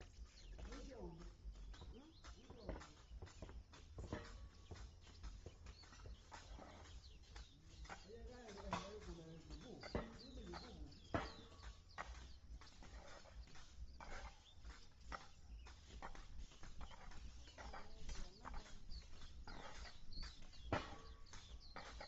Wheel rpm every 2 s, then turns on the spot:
0, 0, 0, 0, 0, 0, 0, 0, 0, 0, 0.
none